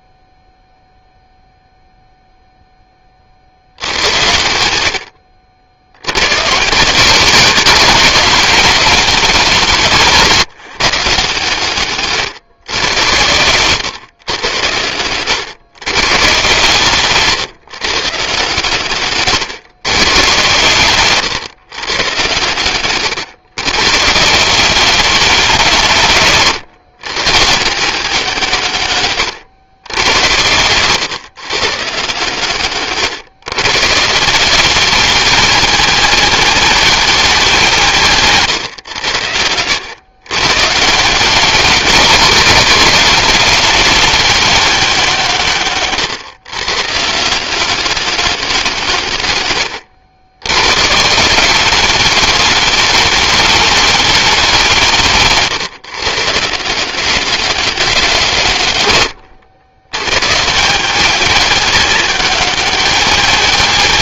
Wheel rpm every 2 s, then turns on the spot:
0, 70, 70, 190, 170, 140, 110, 130, 150, 130, 130, 120, 180, 160, 110, 130, 130, 220, 190, 90, 190, 210, 140, 170, 100, 190, 210, 140, 180, 100, 210, 220.
48-50